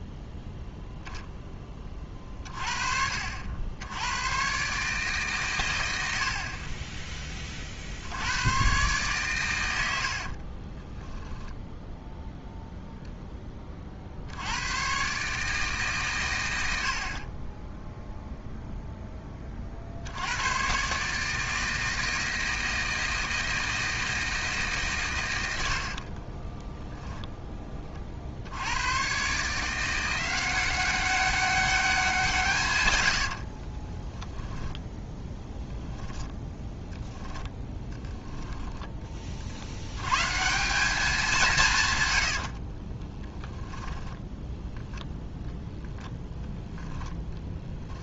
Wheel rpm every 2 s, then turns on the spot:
0, 40, 140, 20, 120, 20, 0, 120, 70, 0, 130, 160, 140, 10, 110, 190, 110, 0, 0, 20, 180, 30, 0, 0.
10-12 32-34 38-40 42-44